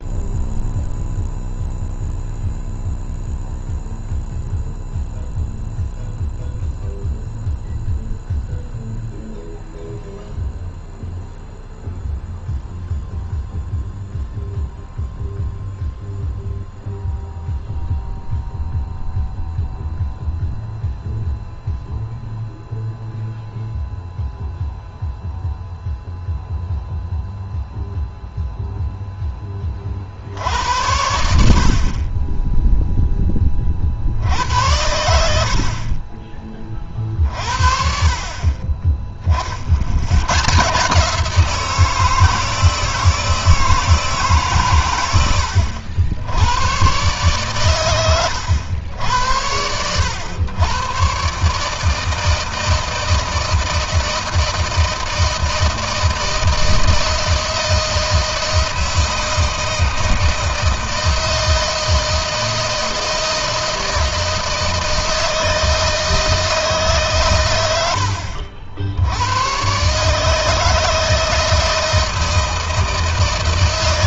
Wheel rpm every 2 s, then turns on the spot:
0, 0, 0, 0, 0, 0, 0, 0, 0, 0, 0, 0, 0, 0, 0, 90, 10, 90, 40, 40, 150, 160, 110, 120, 90, 120, 160, 160, 160, 160, 160, 160, 160, 140, 90, 150, 160.
none